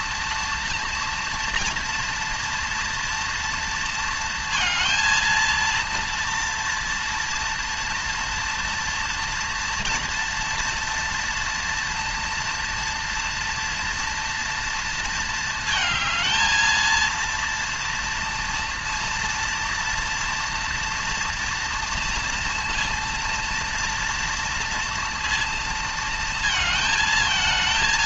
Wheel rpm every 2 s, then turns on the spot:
230, 230, 230, 230, 230, 230, 230, 230, 230, 230, 230, 230, 230, 220.
none